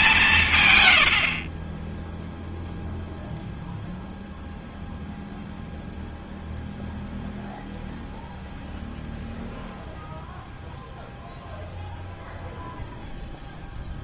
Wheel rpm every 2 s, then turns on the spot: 130, 0, 0, 0, 0, 0, 0.
none